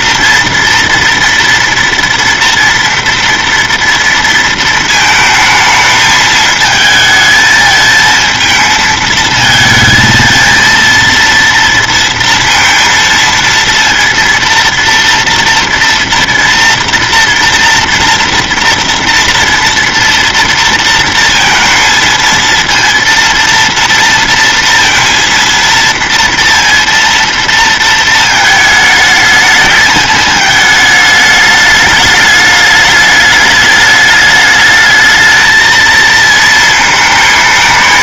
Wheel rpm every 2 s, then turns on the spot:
230, 230, 230, 220, 220, 230, 230, 230, 230, 230, 230, 230, 230, 230, 220, 210, 210, 210, 220.
none